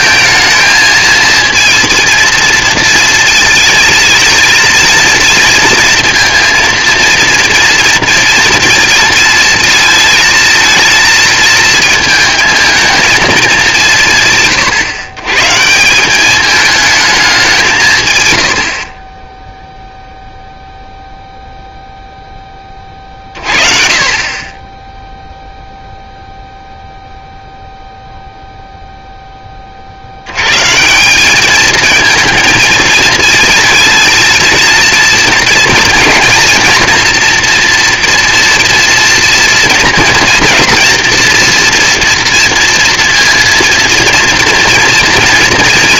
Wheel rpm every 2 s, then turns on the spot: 220, 230, 230, 230, 230, 230, 230, 140, 220, 80, 0, 20, 20, 0, 0, 130, 220, 230, 240, 240, 240, 230, 230.
none